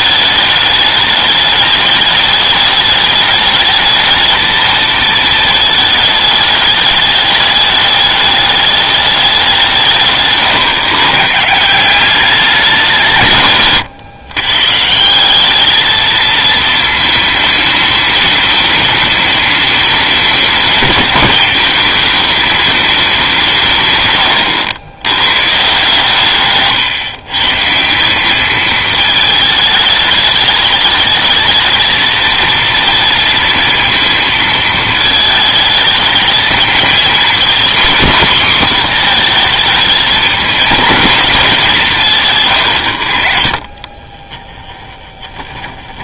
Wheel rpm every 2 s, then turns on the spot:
210, 210, 220, 210, 210, 120, 190, 140, 220, 210, 210, 220, 110, 140, 210, 210, 230, 220, 220, 240, 220, 120, 10.
44-46